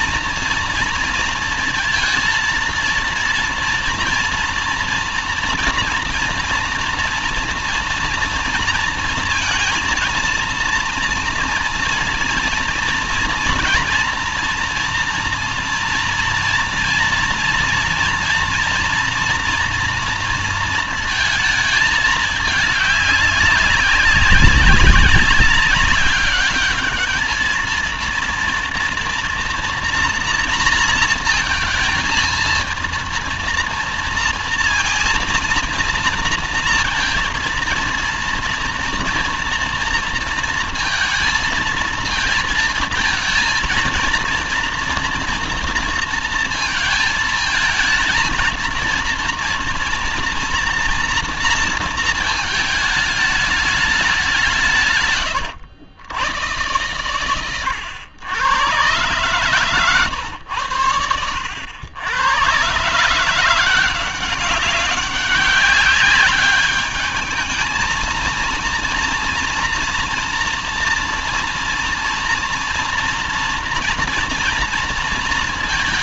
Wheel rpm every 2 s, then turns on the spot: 230, 230, 240, 230, 230, 230, 240, 230, 230, 230, 230, 210, 190, 220, 230, 230, 230, 230, 230, 230, 230, 230, 240, 220, 230, 230, 210, 130, 120, 130, 90, 150, 190, 210, 230, 230, 240, 230.
54-56